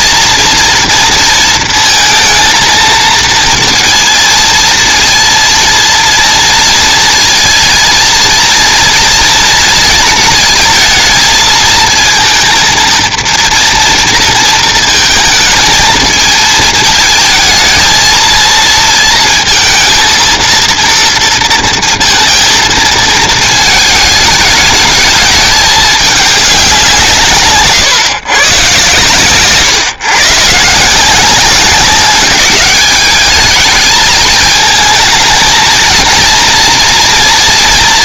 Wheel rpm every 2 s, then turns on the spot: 230, 220, 230, 230, 230, 220, 230, 230, 220, 230, 230, 230, 220, 180, 130, 150, 200, 220, 240.
none